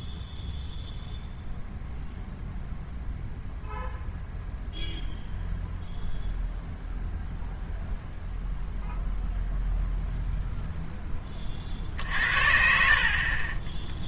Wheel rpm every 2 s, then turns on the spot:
0, 0, 0, 0, 0, 0, 50.
none